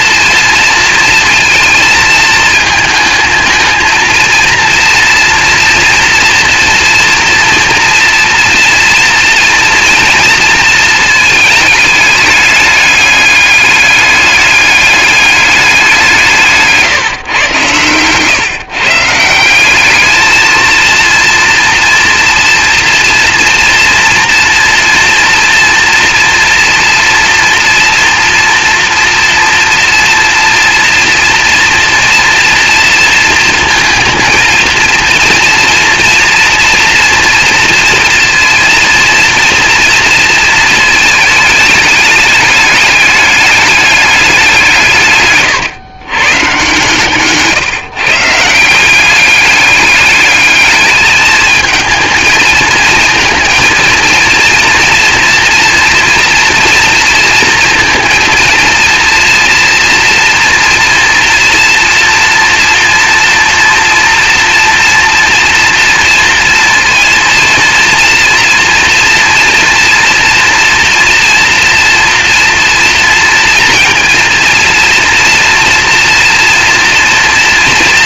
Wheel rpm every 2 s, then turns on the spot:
230, 220, 230, 230, 230, 230, 210, 210, 160, 140, 230, 230, 230, 230, 230, 230, 230, 230, 230, 230, 220, 210, 170, 130, 180, 210, 220, 230, 230, 230, 230, 230, 230, 230, 230, 230, 230, 230, 230.
none